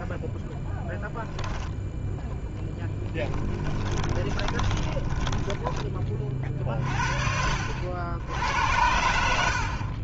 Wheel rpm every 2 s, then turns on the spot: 0, 10, 30, 40, 70.
4-6